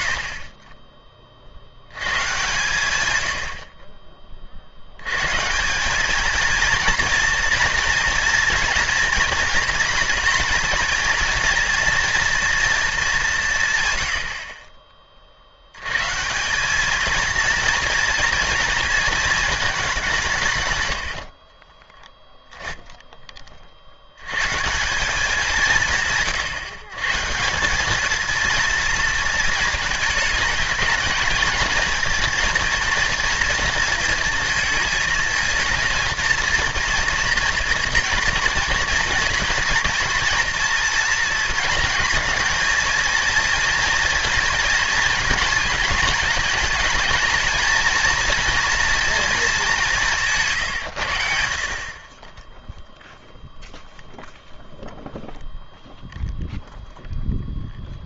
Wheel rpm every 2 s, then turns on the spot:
40, 120, 60, 230, 230, 230, 230, 40, 190, 230, 130, 10, 150, 140, 230, 220, 230, 220, 230, 230, 230, 220, 230, 220, 240, 140, 0, 0, 0.
22-24